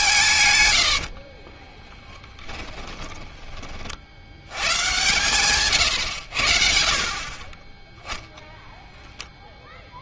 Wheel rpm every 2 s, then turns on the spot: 120, 20, 110, 60, 0.
2-4